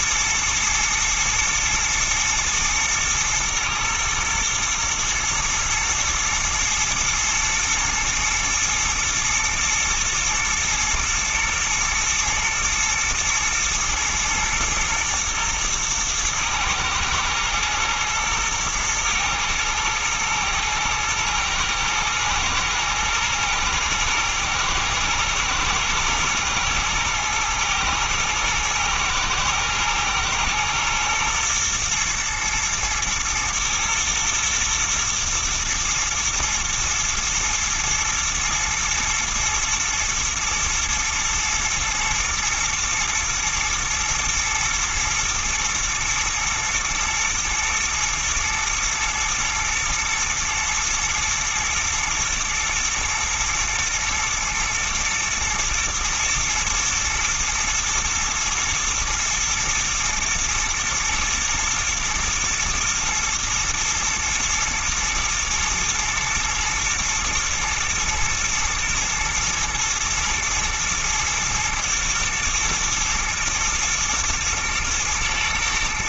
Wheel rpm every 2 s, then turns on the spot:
120, 120, 110, 110, 120, 120, 110, 110, 110, 110, 120, 110, 120, 110, 110, 120, 110, 120, 120, 110, 110, 120, 120, 110, 110, 110, 110, 110, 110, 110, 110, 120, 110, 110, 110, 120, 110, 120.
none